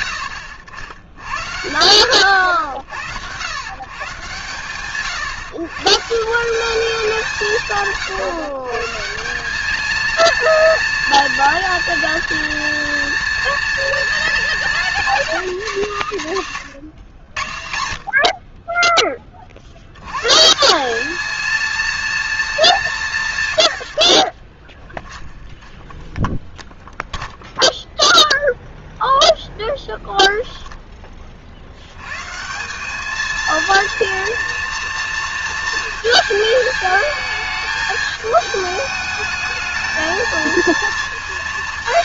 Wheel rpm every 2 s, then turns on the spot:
100, 100, 140, 180, 180, 230, 230, 250, 130, 50, 230, 110, 10, 0, 0, 30, 220, 230, 220, 210, 230.
24-26